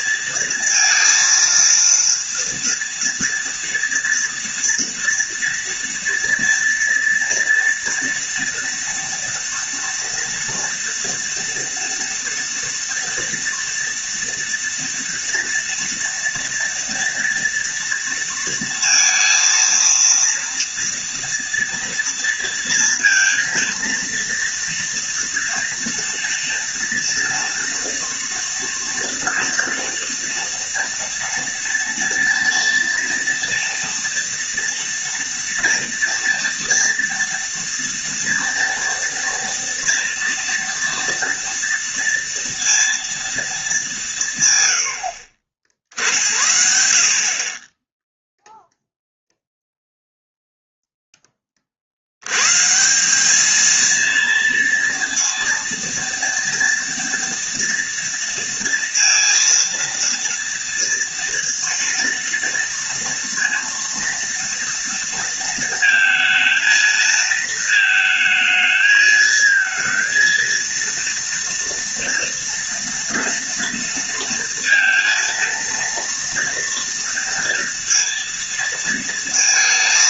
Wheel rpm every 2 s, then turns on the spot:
230, 230, 230, 230, 240, 230, 230, 230, 230, 230, 230, 230, 230, 230, 230, 230, 230, 230, 230, 230, 230, 230, 100, 60, 0, 0, 160, 230, 230, 230, 230, 230, 230, 220, 220, 230, 230, 230, 230, 230.
none